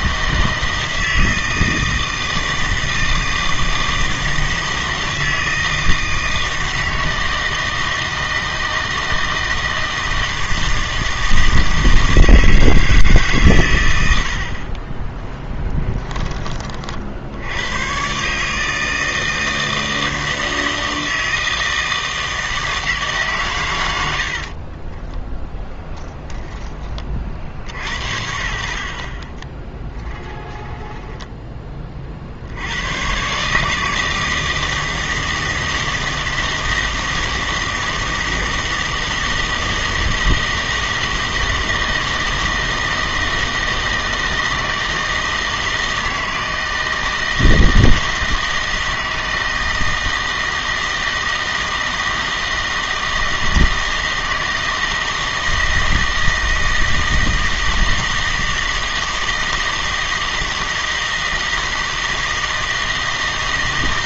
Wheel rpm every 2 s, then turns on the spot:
160, 160, 160, 160, 160, 160, 160, 50, 40, 160, 160, 160, 30, 10, 60, 20, 80, 160, 160, 160, 160, 160, 160, 160, 160, 160, 160, 160, 160, 160, 160, 160.
14-16 24-28 30-32